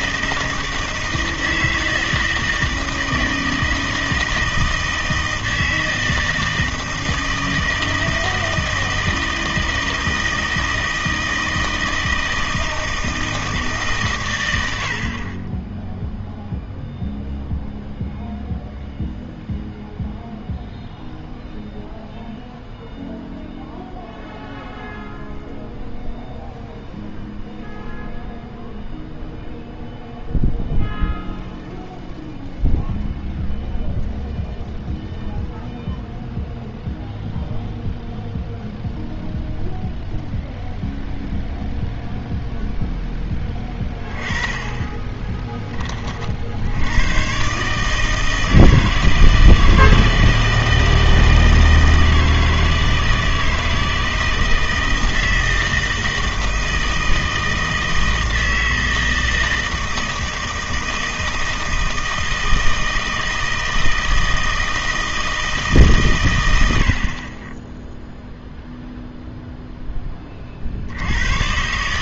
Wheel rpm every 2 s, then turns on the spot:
160, 160, 160, 160, 160, 160, 160, 100, 0, 0, 0, 0, 0, 0, 0, 0, 0, 0, 0, 0, 0, 0, 20, 70, 160, 160, 160, 160, 160, 160, 160, 160, 160, 90, 0, 50.
none